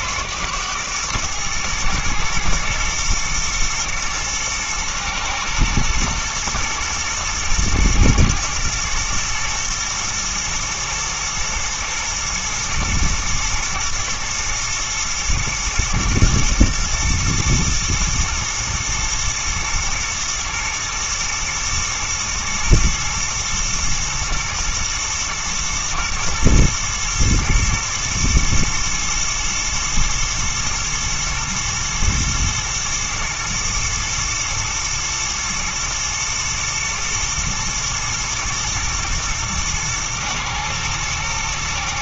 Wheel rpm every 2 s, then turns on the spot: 110, 120, 110, 110, 120, 110, 120, 110, 110, 110, 120, 110, 110, 110, 110, 120, 110, 120, 120, 110, 110.
none